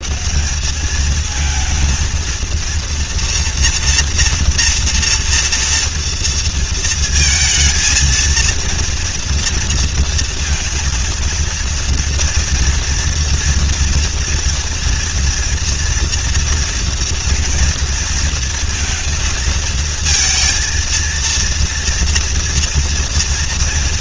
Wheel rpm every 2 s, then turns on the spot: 220, 230, 230, 230, 230, 230, 230, 230, 230, 230, 220, 230.
none